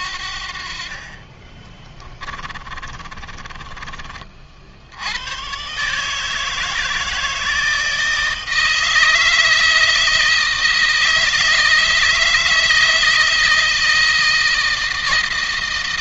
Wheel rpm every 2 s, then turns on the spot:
50, 30, 60, 160, 160, 160, 160, 160.
2-4